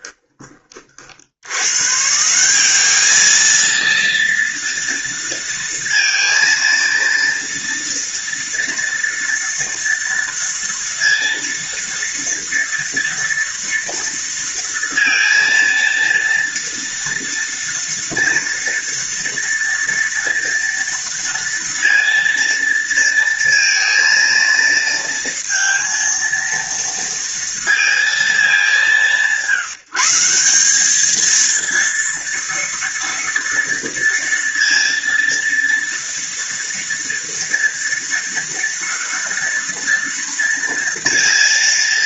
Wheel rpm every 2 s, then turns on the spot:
80, 220, 230, 230, 230, 230, 230, 230, 230, 230, 230, 230, 230, 230, 170, 220, 230, 230, 230, 230, 230.
none